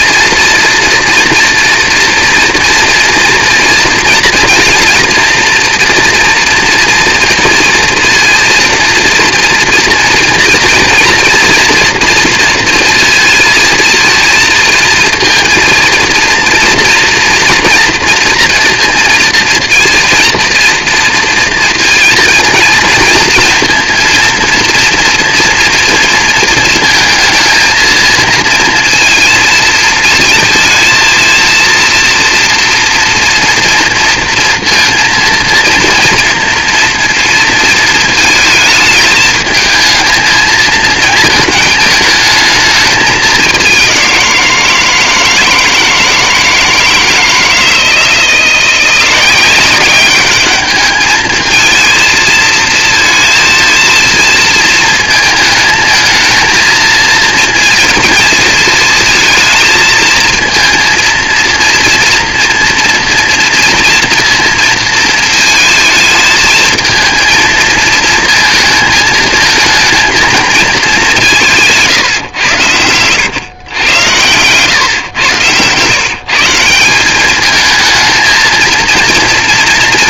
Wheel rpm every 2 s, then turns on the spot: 230, 230, 230, 240, 230, 230, 230, 230, 230, 230, 230, 230, 230, 230, 230, 230, 230, 230, 230, 220, 220, 220, 170, 160, 170, 200, 230, 230, 230, 230, 230, 230, 230, 220, 230, 220, 110, 130, 160, 220.
none